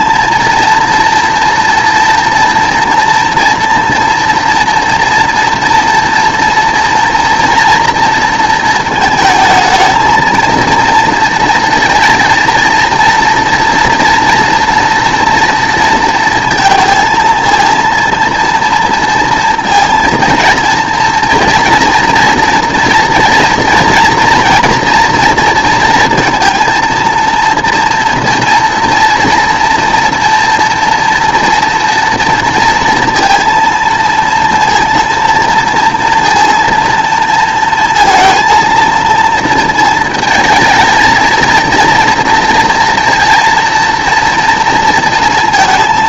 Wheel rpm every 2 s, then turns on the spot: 230, 240, 230, 230, 220, 230, 230, 230, 230, 230, 230, 230, 230, 230, 230, 230, 230, 230, 230, 230, 220, 230, 230.
none